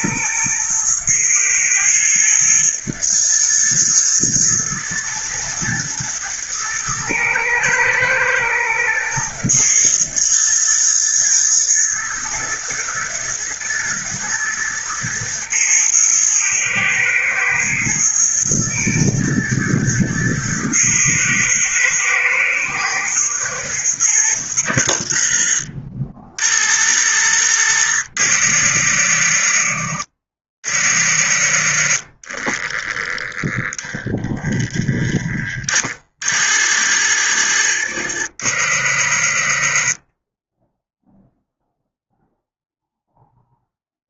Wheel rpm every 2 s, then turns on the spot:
120, 120, 110, 110, 110, 120, 110, 110, 110, 120, 110, 110, 60, 40, 40, 40, 10, 10, 50, 40, 0, 0.
none